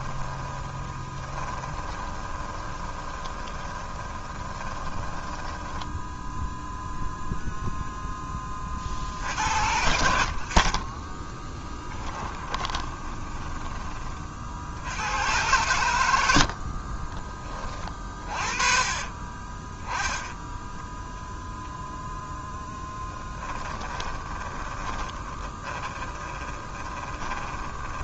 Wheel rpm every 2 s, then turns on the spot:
20, 30, 20, 0, 40, 40, 20, 80, 40, 30, 10, 10, 20, 20.
0-6 10-14 16-20 22-28